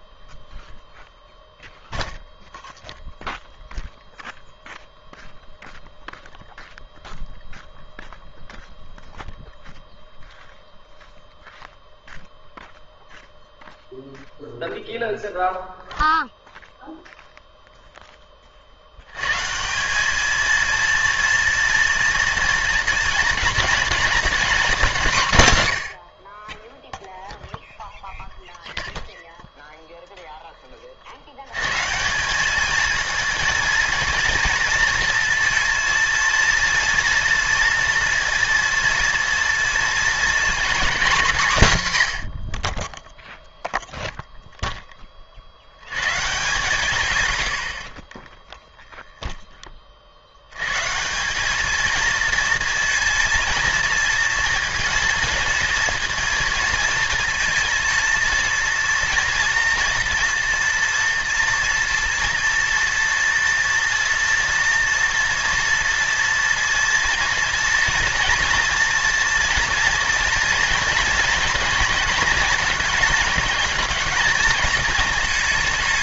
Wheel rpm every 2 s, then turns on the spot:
0, 0, 0, 0, 0, 0, 0, 0, 0, 40, 230, 230, 220, 10, 0, 10, 200, 230, 230, 230, 250, 50, 10, 140, 0, 120, 230, 230, 230, 240, 230, 230, 230, 230, 230, 230, 230, 220.
none